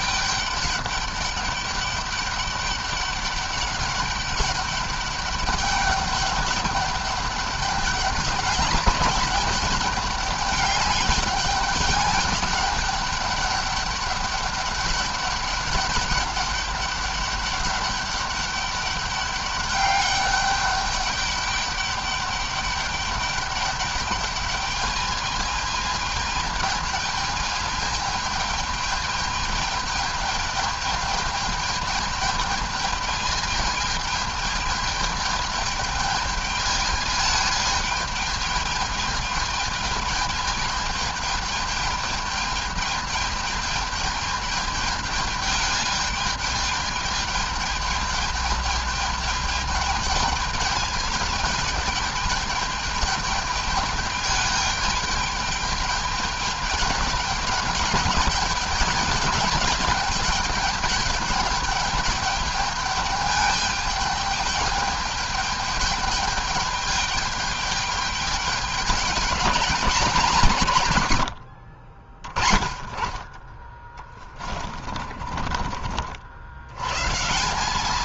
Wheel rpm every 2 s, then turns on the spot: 200, 200, 200, 200, 200, 200, 210, 200, 200, 200, 200, 200, 210, 220, 210, 220, 220, 210, 210, 220, 220, 210, 210, 210, 210, 220, 210, 210, 210, 210, 210, 210, 210, 210, 200, 120, 20, 30, 110.
74-76